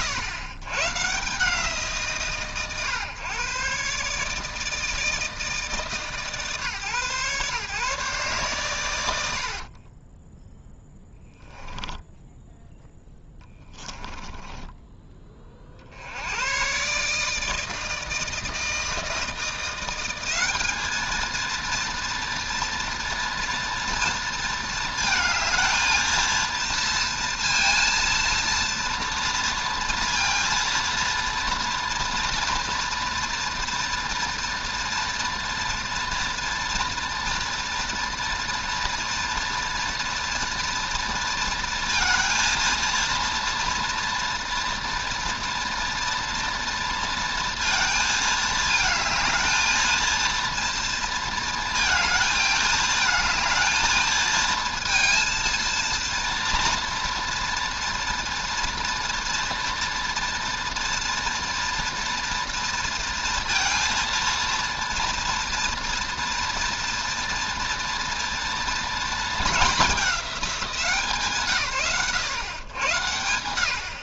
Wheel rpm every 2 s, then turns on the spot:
110, 120, 160, 140, 140, 0, 0, 10, 130, 160, 210, 230, 220, 230, 230, 230, 230, 230, 230, 230, 230, 230, 230, 230, 220, 230, 220, 230, 240, 230, 230, 230, 230, 230, 230, 200, 110.
14-16